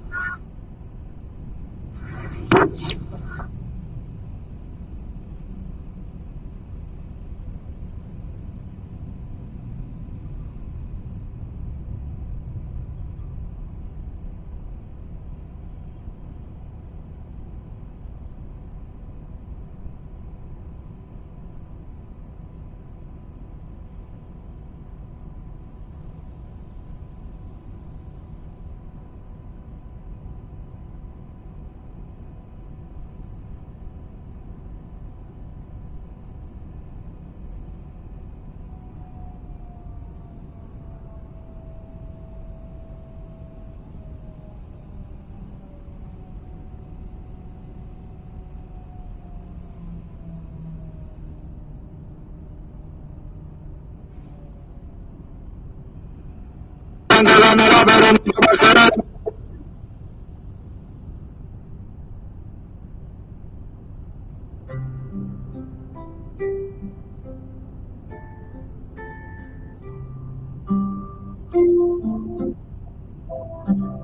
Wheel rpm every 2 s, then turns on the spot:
0, 0, 0, 0, 0, 0, 0, 0, 0, 0, 0, 0, 0, 0, 0, 0, 0, 0, 0, 0, 0, 0, 0, 0, 0, 0, 0, 0, 0, 0, 0, 0, 0, 0, 0, 0, 0.
none